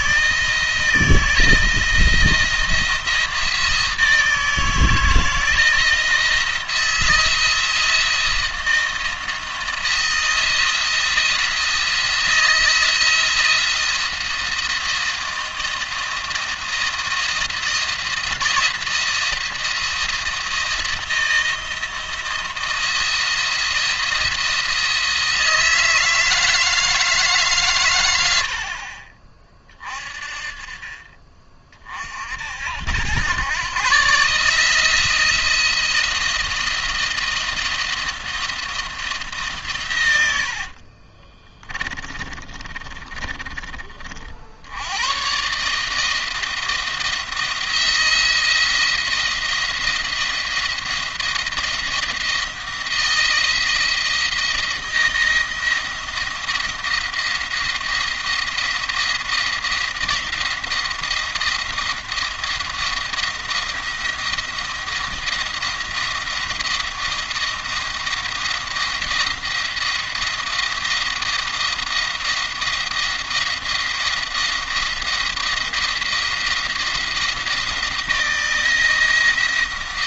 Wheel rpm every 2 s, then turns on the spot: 170, 170, 160, 170, 170, 170, 160, 170, 170, 170, 170, 170, 170, 160, 50, 40, 90, 160, 170, 170, 50, 30, 100, 160, 170, 170, 170, 170, 170, 170, 170, 170, 170, 170, 170, 170, 170, 170, 170, 170.
40-44